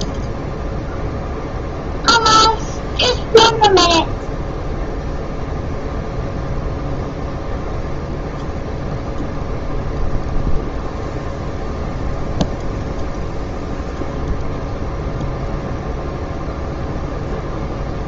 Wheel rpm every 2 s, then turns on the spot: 0, 0, 0, 0, 0, 0, 0, 0, 0.
none